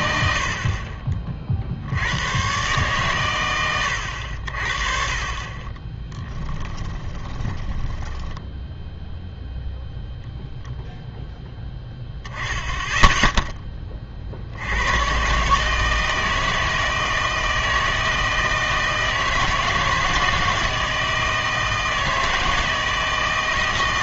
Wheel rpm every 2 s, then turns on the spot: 50, 120, 50, 10, 0, 0, 10, 90, 160, 160, 160, 160.
6-8